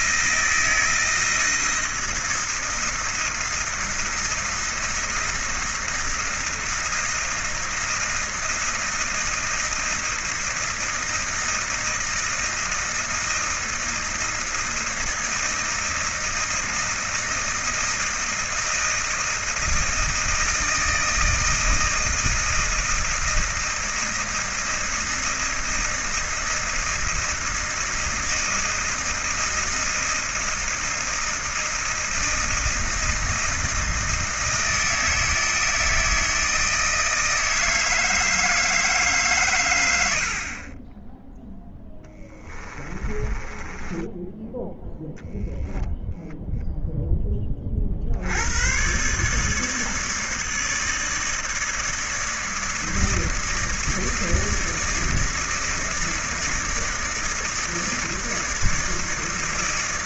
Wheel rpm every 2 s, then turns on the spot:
160, 160, 160, 160, 160, 160, 160, 160, 160, 160, 160, 160, 160, 160, 160, 160, 160, 160, 160, 160, 40, 20, 0, 0, 110, 160, 160, 160, 160, 160.
42-44